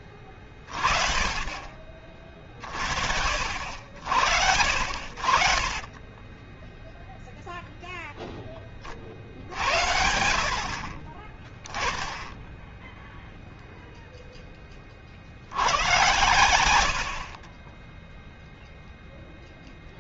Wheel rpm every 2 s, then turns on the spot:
60, 20, 0, 60, 10, 0, 80, 30, 0, 0.
2-4